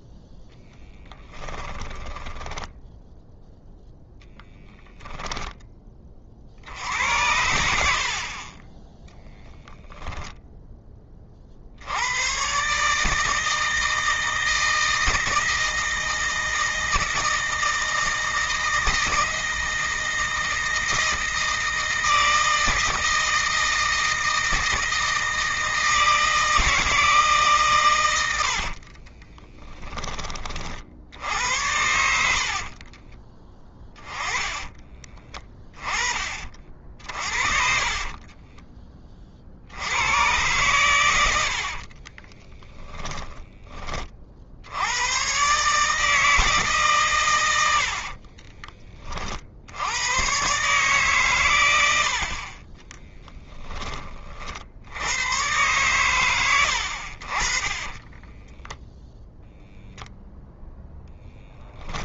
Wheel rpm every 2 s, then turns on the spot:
10, 0, 10, 80, 10, 20, 150, 160, 160, 160, 160, 160, 160, 160, 50, 60, 40, 20, 60, 30, 110, 10, 110, 140, 40, 130, 20, 80, 70, 0, 0.
0-2 28-30 32-38 52-54